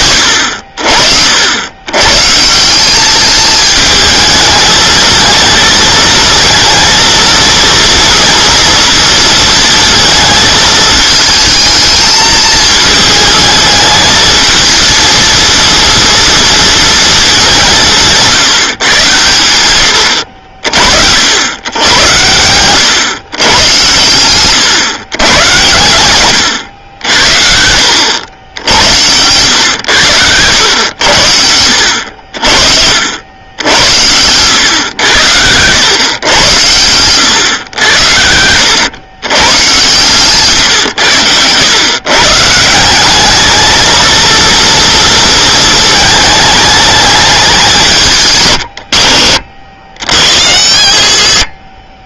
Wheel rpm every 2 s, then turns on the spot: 60, 180, 220, 230, 230, 220, 220, 230, 230, 140, 60, 130, 120, 90, 90, 100, 60, 100, 110, 110, 120, 170, 230, 210, 90, 70.
28-30 36-38